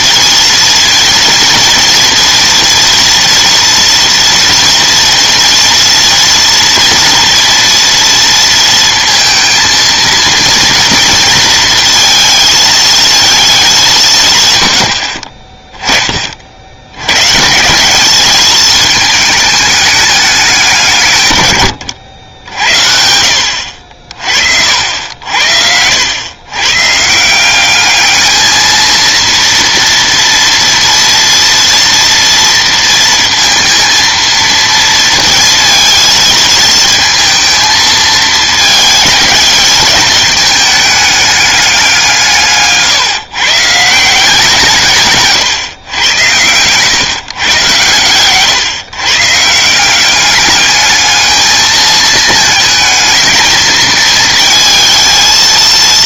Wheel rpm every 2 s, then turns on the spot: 230, 230, 230, 230, 230, 230, 220, 90, 80, 220, 170, 70, 60, 120, 220, 230, 230, 230, 230, 220, 210, 140, 170, 110, 130, 210, 220, 220.
none